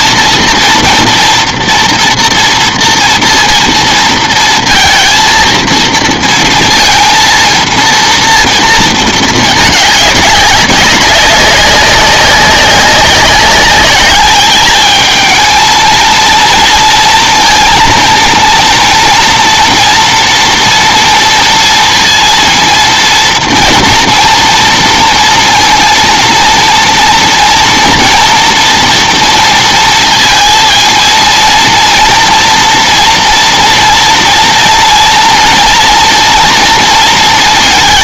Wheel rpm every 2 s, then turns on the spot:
230, 240, 230, 230, 230, 190, 200, 210, 230, 230, 230, 230, 230, 230, 230, 230, 230, 230, 230.
none